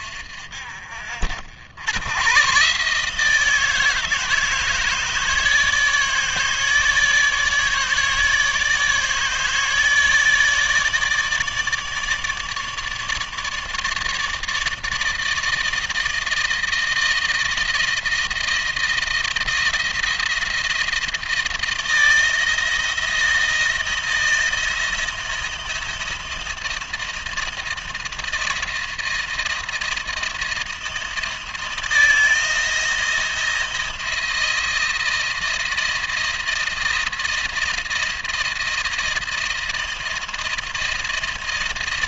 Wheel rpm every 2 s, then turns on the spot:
60, 130, 160, 150, 150, 150, 150, 150, 160, 160, 170, 160, 160, 160, 170, 170, 160, 170, 160, 170, 160.
none